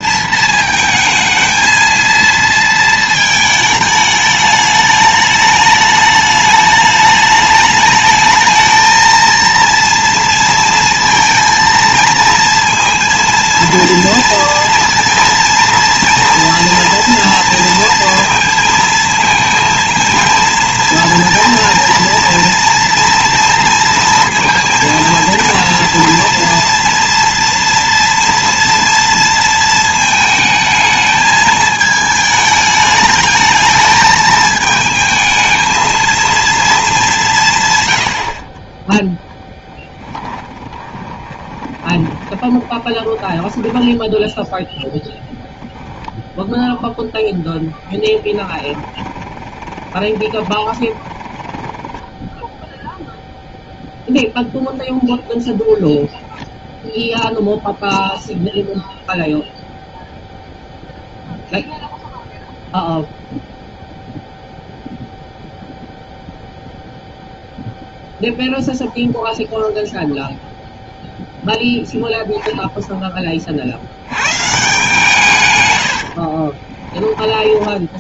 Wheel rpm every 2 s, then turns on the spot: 220, 230, 210, 210, 220, 230, 230, 230, 230, 230, 230, 230, 230, 230, 230, 220, 210, 220, 220, 30, 20, 20, 10, 10, 20, 20, 0, 0, 0, 0, 0, 0, 0, 0, 0, 0, 0, 150, 30.
40-44 48-52 76-78